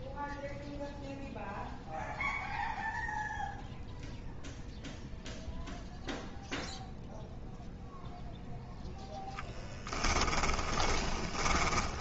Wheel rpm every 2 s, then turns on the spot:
0, 0, 0, 0, 0, 20.
10-12